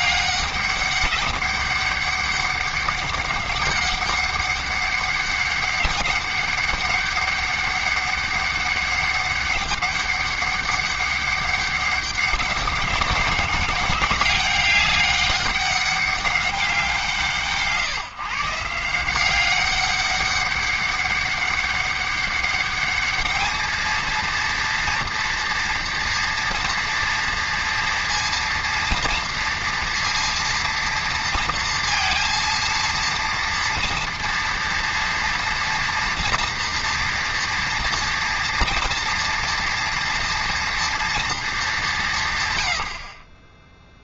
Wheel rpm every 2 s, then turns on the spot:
200, 200, 200, 200, 200, 200, 200, 200, 190, 160, 200, 200, 230, 230, 230, 230, 230, 230, 230, 230, 230, 90.
none